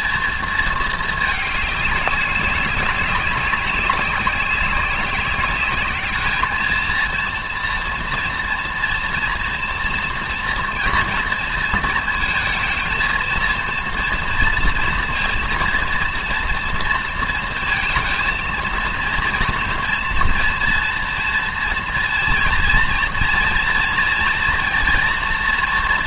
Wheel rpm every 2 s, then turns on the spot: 230, 190, 190, 220, 230, 240, 220, 230, 230, 230, 230, 230, 230.
none